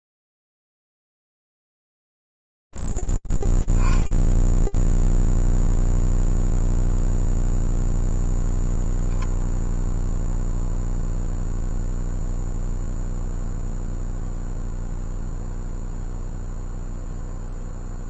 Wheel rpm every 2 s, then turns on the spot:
0, 0, 0, 0, 0, 0, 0, 0, 0.
none